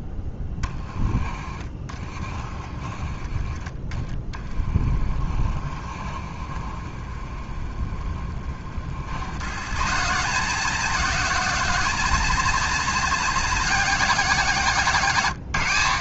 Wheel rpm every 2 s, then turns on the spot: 10, 20, 10, 30, 70, 170, 180, 160.
none